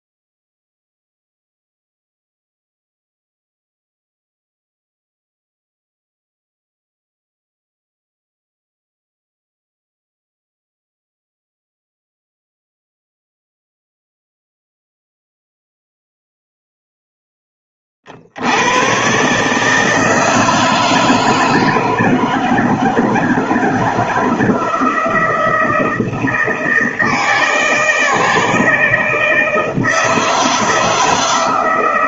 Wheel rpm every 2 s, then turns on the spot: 0, 0, 0, 0, 0, 0, 0, 0, 0, 70, 160, 160, 160, 160, 160, 160.
none